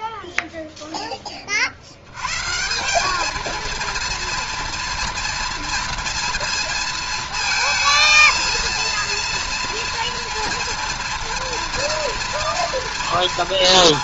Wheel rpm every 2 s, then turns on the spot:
90, 230, 230, 230, 230, 240, 230.
none